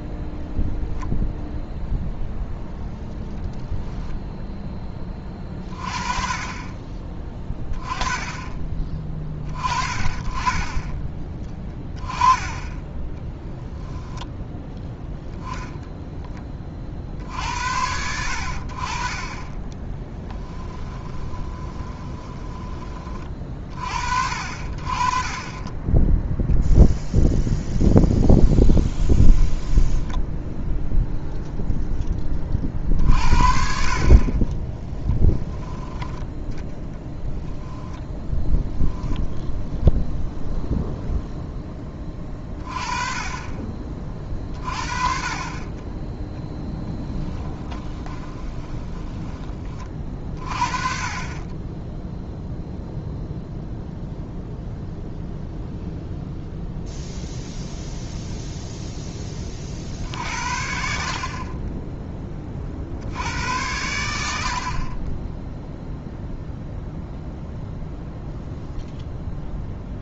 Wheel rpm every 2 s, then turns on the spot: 0, 0, 10, 20, 20, 20, 10, 10, 30, 60, 20, 30, 40, 0, 10, 0, 40, 20, 10, 10, 0, 30, 50, 0, 20, 40, 0, 0, 0, 0, 60, 50, 50, 0, 0.
12-14 20-22 28-30 34-36 38-40 48-50